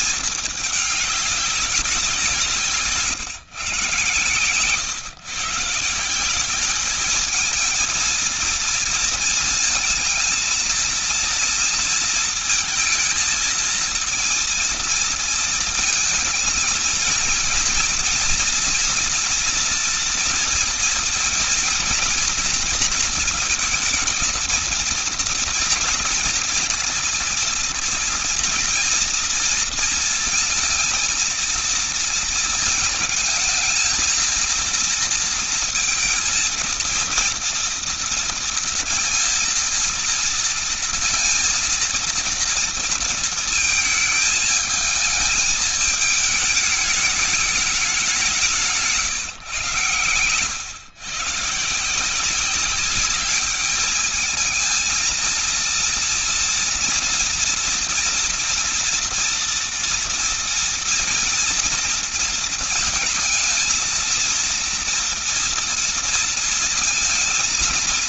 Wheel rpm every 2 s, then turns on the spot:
210, 160, 120, 190, 230, 230, 230, 230, 230, 230, 230, 230, 230, 230, 230, 230, 220, 230, 230, 230, 230, 230, 220, 210, 180, 120, 180, 220, 230, 230, 230, 230, 230, 230.
none